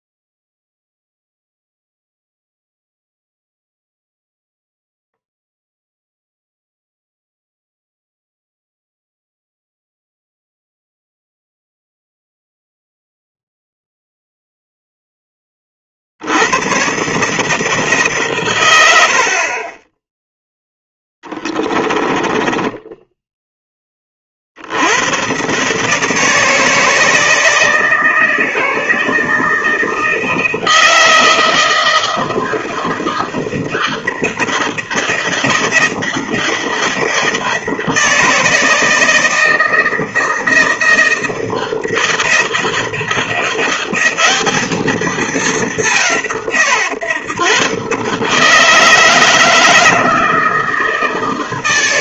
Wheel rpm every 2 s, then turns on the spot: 0, 0, 0, 0, 0, 0, 0, 0, 110, 100, 0, 10, 70, 160, 160, 160, 160, 160, 160, 160, 160, 160, 210, 140, 150, 160.
22-24